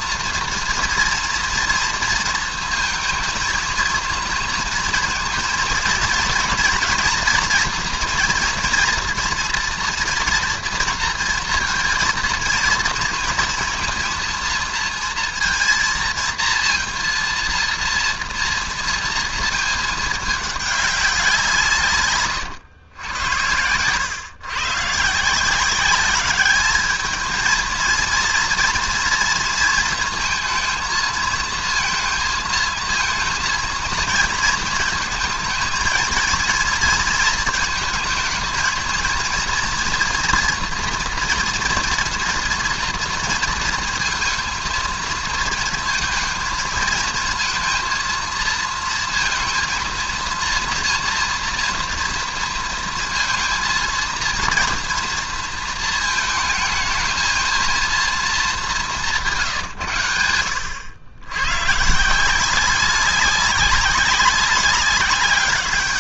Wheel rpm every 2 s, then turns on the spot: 230, 230, 230, 230, 230, 230, 230, 230, 230, 230, 210, 110, 120, 210, 230, 230, 230, 230, 230, 220, 230, 230, 230, 220, 230, 230, 230, 230, 220, 210, 90, 180, 200.
none